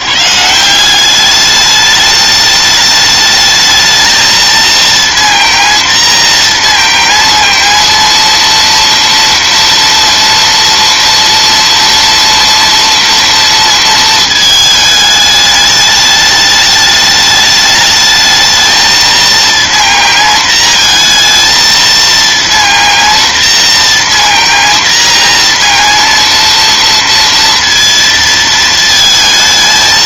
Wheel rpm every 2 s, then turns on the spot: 80, 210, 220, 230, 230, 240, 230, 220, 210, 220, 230, 230, 230, 230, 230.
none